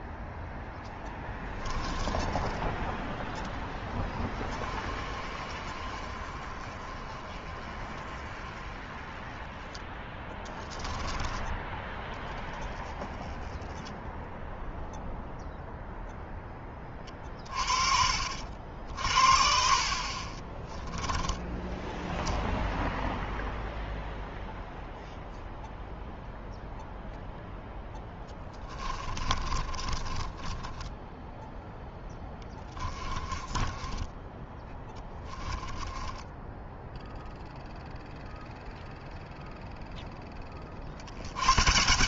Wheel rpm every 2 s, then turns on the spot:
0, 10, 20, 30, 20, 10, 10, 0, 10, 60, 10, 0, 0, 0, 20, 20, 20, 10, 10, 0, 40.
10-12 20-22 28-38